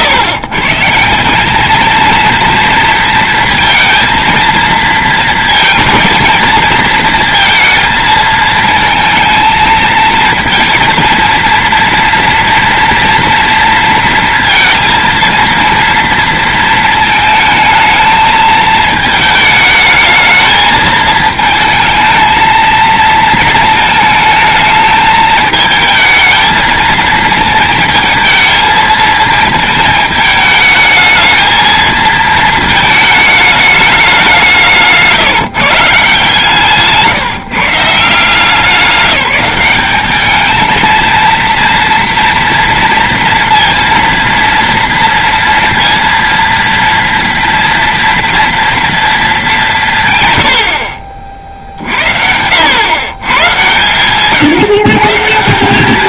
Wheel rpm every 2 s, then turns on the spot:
120, 230, 230, 230, 220, 230, 230, 230, 230, 220, 220, 220, 220, 220, 220, 220, 220, 170, 150, 180, 220, 230, 230, 230, 230, 90, 100, 150.
36-38